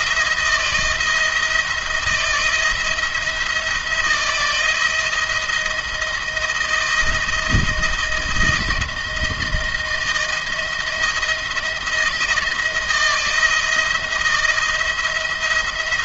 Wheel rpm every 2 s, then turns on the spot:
170, 170, 170, 170, 160, 170, 160, 170.
none